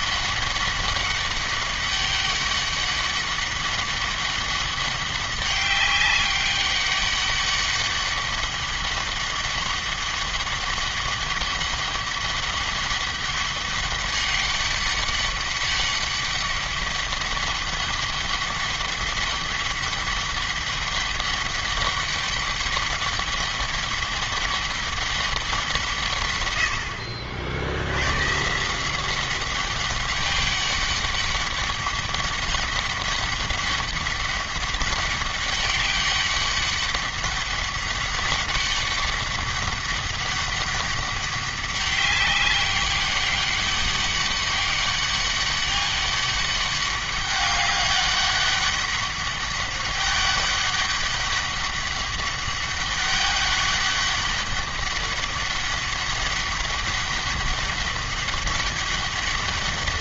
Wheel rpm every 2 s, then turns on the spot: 200, 200, 200, 200, 200, 200, 200, 200, 200, 200, 200, 200, 200, 80, 170, 200, 200, 200, 200, 200, 200, 190, 200, 200, 200, 200, 200, 200, 200, 200.
none